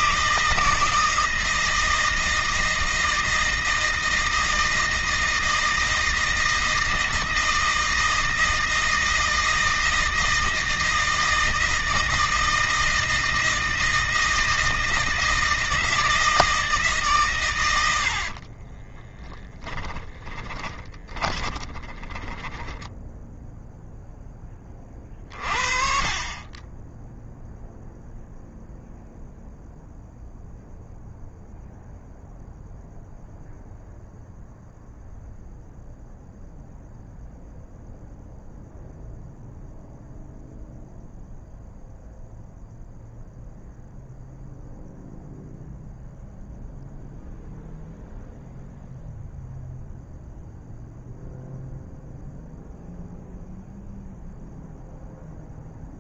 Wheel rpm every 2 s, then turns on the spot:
160, 160, 160, 160, 160, 160, 160, 160, 150, 30, 20, 10, 40, 10, 0, 0, 0, 0, 0, 0, 0, 0, 0, 0, 0, 0, 0, 0.
18-22